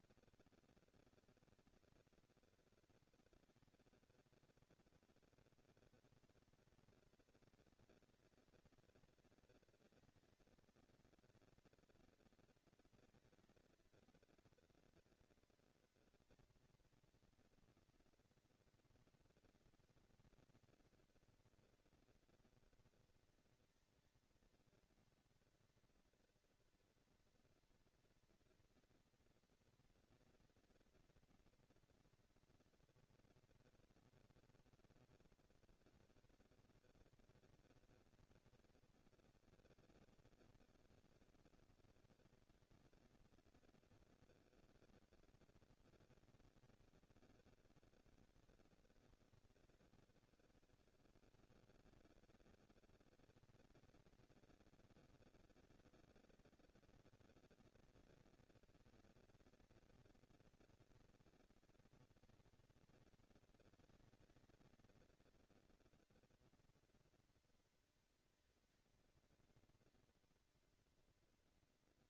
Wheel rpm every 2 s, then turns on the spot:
200, 200, 210, 230, 230, 230, 230, 230, 230, 230, 230, 230, 230, 230, 230, 230, 230, 230, 220, 230, 220, 230, 230, 220, 200, 110, 190, 230, 230, 230, 230, 230, 230, 230, 230, 230.
50-52